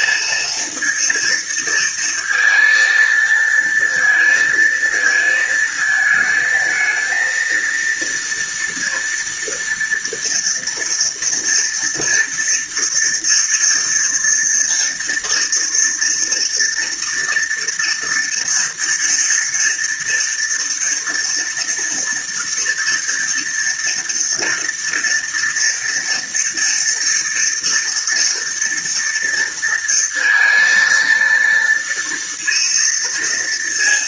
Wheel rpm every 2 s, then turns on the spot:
230, 230, 220, 220, 230, 230, 230, 230, 230, 230, 230, 230, 230, 230, 230, 230, 230.
none